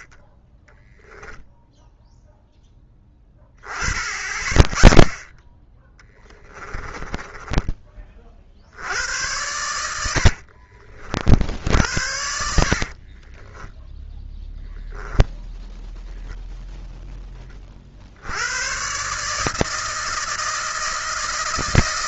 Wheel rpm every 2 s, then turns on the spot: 10, 10, 20, 10, 80, 50, 70, 0, 0, 130, 160.
0-2 6-8 12-14